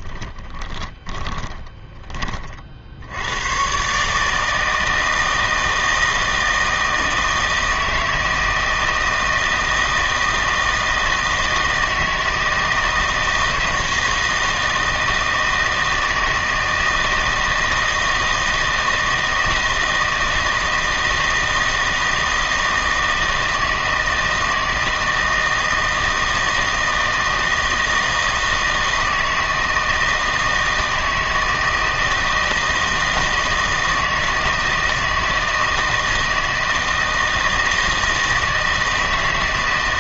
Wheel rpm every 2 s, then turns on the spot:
20, 60, 160, 160, 160, 160, 160, 160, 160, 160, 160, 160, 160, 160, 160, 160, 160, 160, 160, 160.
0-2